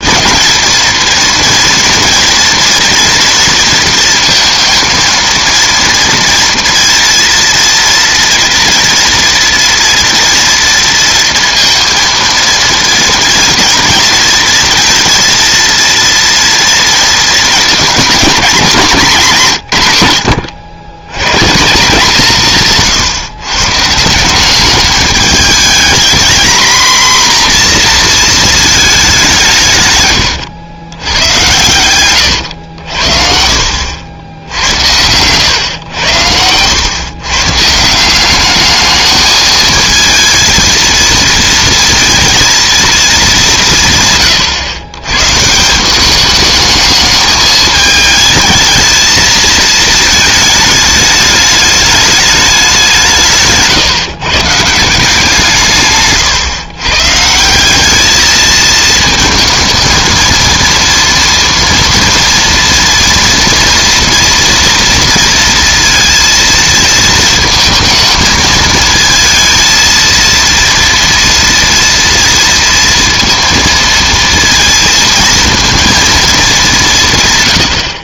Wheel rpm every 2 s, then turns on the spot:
230, 230, 230, 230, 230, 230, 230, 230, 230, 220, 90, 160, 200, 230, 220, 100, 90, 80, 110, 210, 230, 230, 120, 210, 220, 210, 190, 160, 130, 220, 230, 230, 230, 230, 220, 230, 230, 230, 190.
34-36